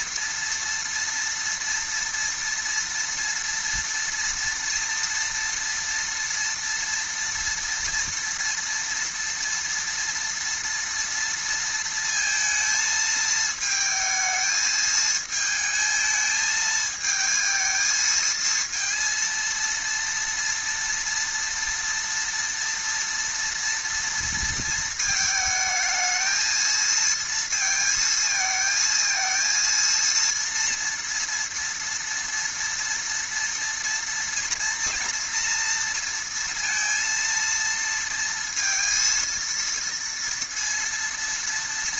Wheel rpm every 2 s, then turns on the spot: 230, 230, 230, 230, 230, 230, 220, 220, 220, 220, 230, 230, 230, 220, 220, 230, 230, 230, 230, 230, 230.
none